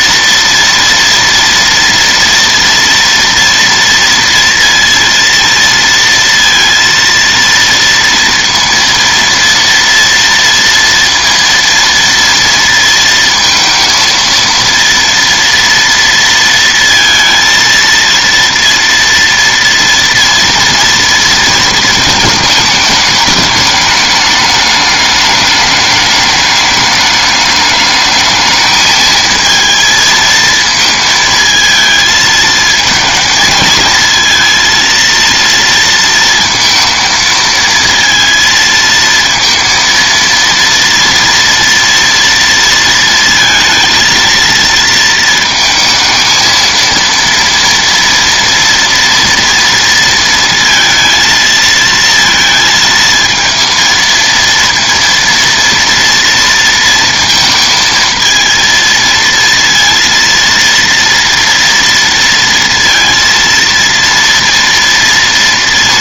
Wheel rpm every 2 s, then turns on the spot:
230, 230, 230, 230, 230, 230, 230, 230, 230, 230, 230, 210, 210, 210, 220, 220, 220, 230, 230, 230, 230, 230, 230, 230, 230, 230, 220, 230, 230, 230, 230, 230, 230.
none